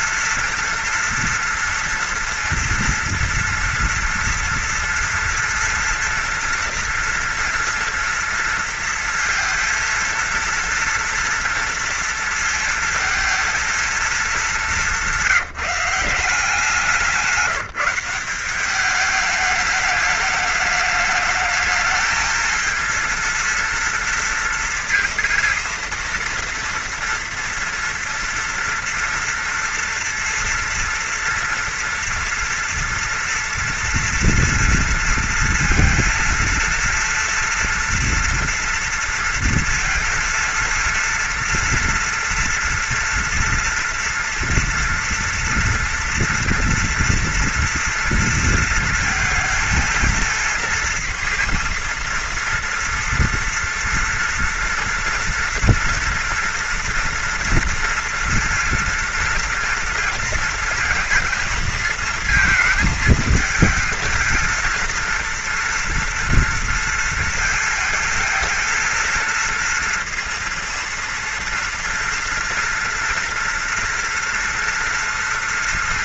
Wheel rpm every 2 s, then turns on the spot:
230, 230, 240, 230, 230, 230, 230, 220, 170, 180, 210, 230, 230, 230, 230, 230, 230, 230, 230, 230, 230, 230, 230, 230, 230, 230, 230, 230, 230, 230, 230, 220, 230, 230, 220, 230, 230, 230.
none